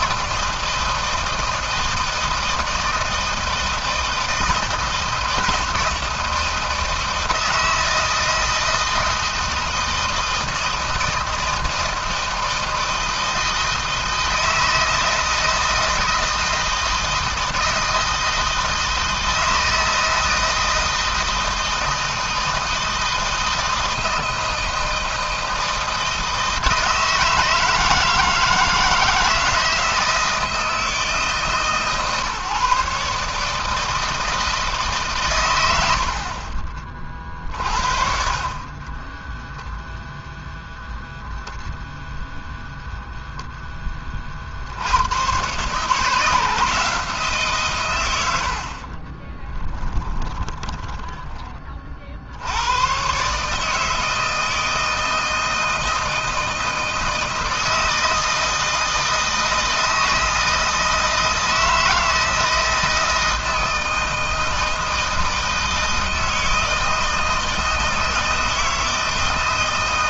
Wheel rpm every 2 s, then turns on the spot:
160, 160, 160, 160, 160, 160, 160, 160, 160, 160, 160, 160, 160, 160, 160, 160, 150, 140, 40, 30, 0, 0, 80, 160, 40, 20, 110, 160, 160, 160, 160, 160, 160, 160, 160.
38-40 48-52